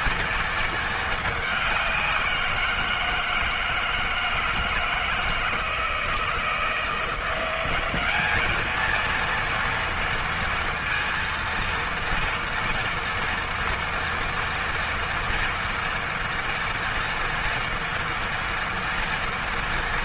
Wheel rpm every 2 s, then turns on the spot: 210, 160, 160, 170, 230, 230, 230, 230, 230, 230.
none